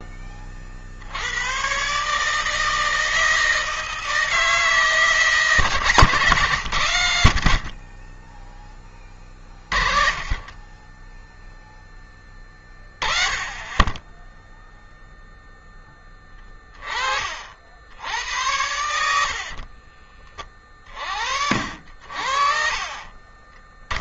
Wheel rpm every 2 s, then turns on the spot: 30, 160, 160, 130, 30, 40, 10, 0, 20, 80, 40, 60.
10-12 18-20